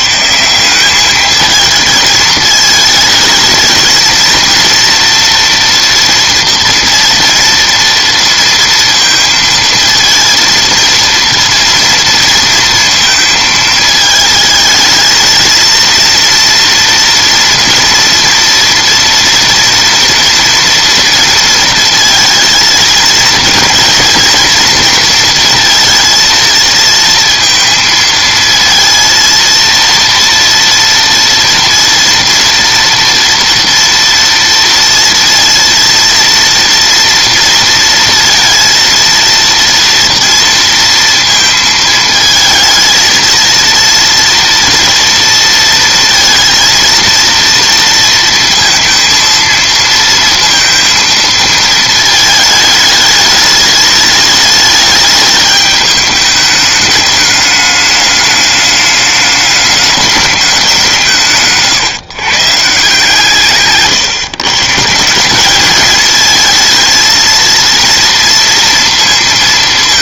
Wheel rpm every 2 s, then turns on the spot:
170, 220, 230, 230, 230, 230, 230, 220, 230, 230, 230, 220, 230, 230, 230, 230, 230, 230, 230, 230, 230, 220, 230, 230, 230, 230, 220, 210, 210, 210, 190, 150, 140, 220, 230.
none